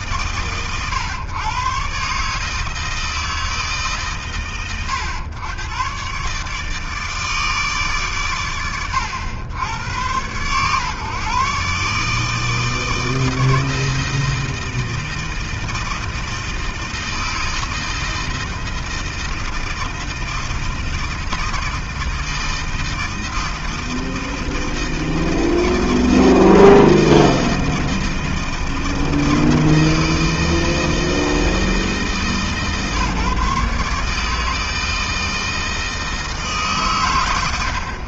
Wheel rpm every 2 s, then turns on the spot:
110, 160, 110, 160, 90, 140, 160, 160, 160, 160, 160, 160, 160, 160, 160, 160, 140, 160, 100.
none